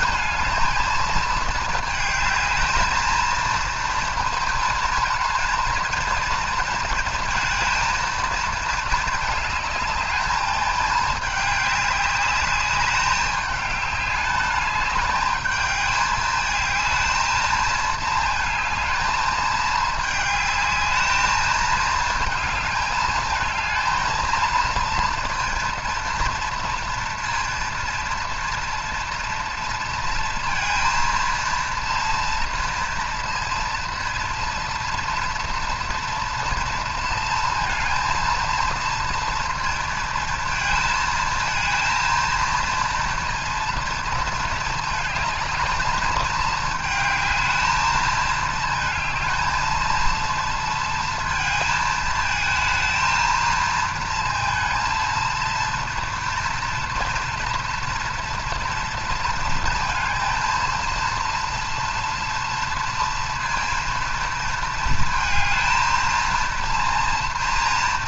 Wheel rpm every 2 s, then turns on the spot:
230, 220, 220, 220, 230, 220, 210, 210, 210, 220, 210, 220, 230, 230, 230, 230, 230, 230, 230, 230, 230, 230, 220, 220, 220, 230, 220, 230, 230, 230, 230, 230, 220, 230.
none